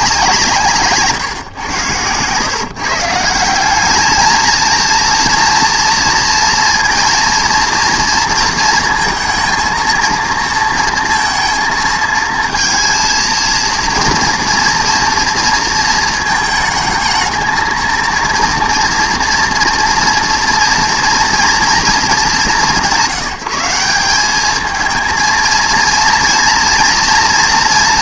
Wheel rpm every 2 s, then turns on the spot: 150, 160, 230, 230, 230, 230, 230, 230, 220, 230, 230, 160, 220, 230.
none